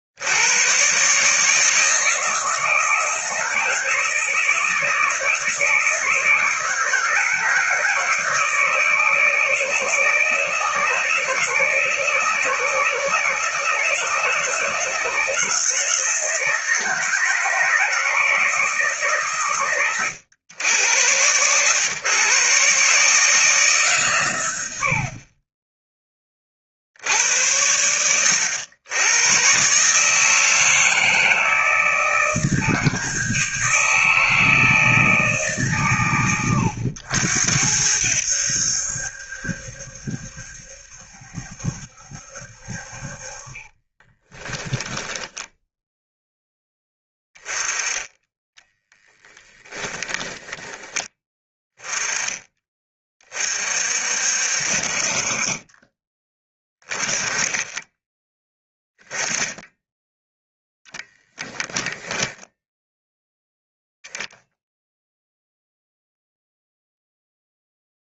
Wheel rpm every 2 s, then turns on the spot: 130, 160, 160, 160, 160, 150, 160, 160, 160, 140, 100, 150, 60, 80, 110, 160, 160, 160, 90, 70, 70, 50, 10, 10, 10, 20, 20, 50, 20, 10, 0, 0, 0, 0.
44-46 48-50